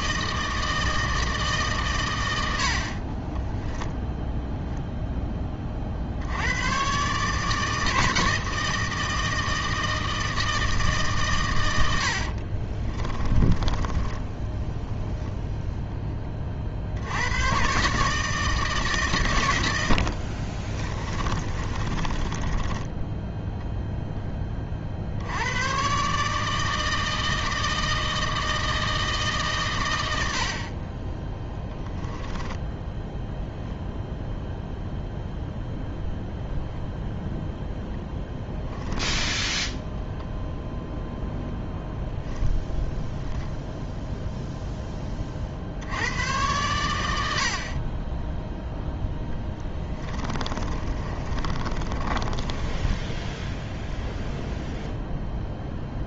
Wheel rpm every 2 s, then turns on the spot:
160, 70, 0, 110, 160, 160, 40, 0, 60, 150, 30, 10, 40, 160, 160, 40, 10, 0, 0, 10, 0, 0, 0, 100, 0, 40, 20, 0.
12-14 20-24 32-34 38-40 50-54